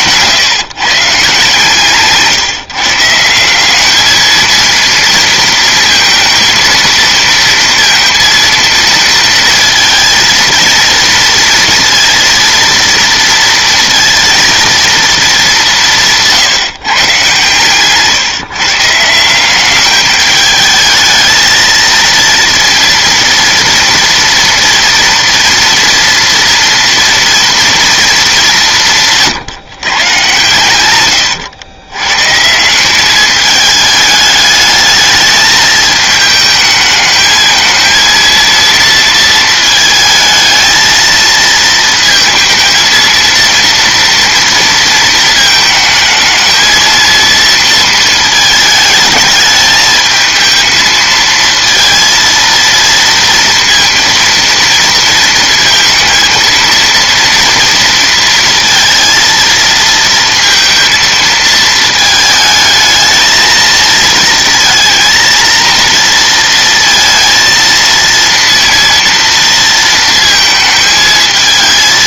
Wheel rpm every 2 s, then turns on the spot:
140, 160, 230, 230, 230, 230, 230, 220, 140, 160, 220, 240, 230, 230, 160, 120, 200, 220, 220, 230, 220, 230, 230, 220, 210, 220, 230, 230, 230, 230, 230, 220, 230, 230, 230, 220.
30-32